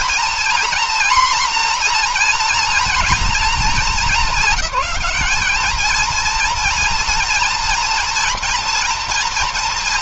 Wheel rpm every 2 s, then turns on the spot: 240, 240, 210, 230, 230.
none